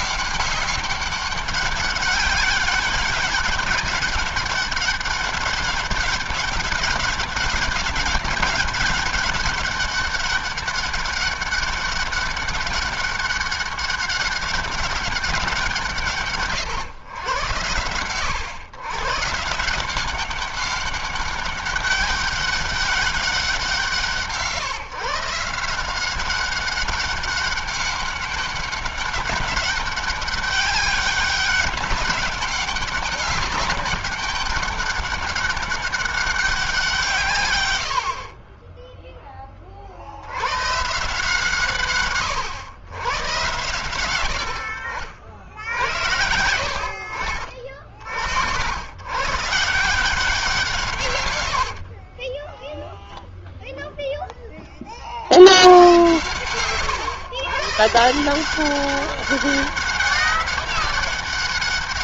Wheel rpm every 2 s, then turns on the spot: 200, 200, 200, 190, 200, 200, 200, 200, 120, 120, 200, 200, 140, 190, 200, 190, 200, 200, 180, 20, 130, 100, 80, 70, 90, 160, 10, 20, 110, 190, 200.
50-54